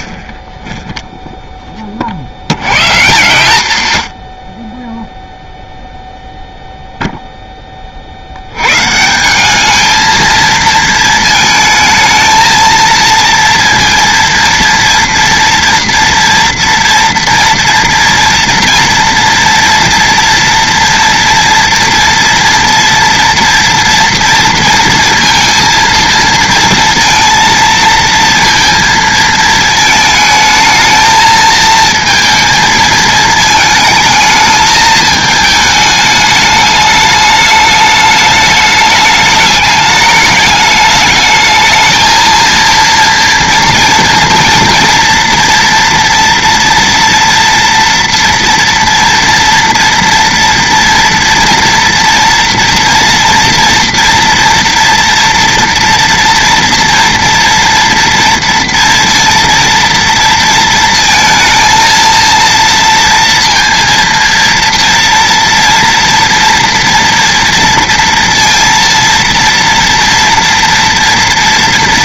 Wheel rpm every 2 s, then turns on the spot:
10, 130, 20, 0, 120, 220, 230, 230, 230, 230, 230, 230, 230, 230, 230, 220, 220, 220, 210, 210, 210, 230, 240, 240, 230, 230, 230, 240, 230, 230, 230, 230, 230, 230, 230, 240.
none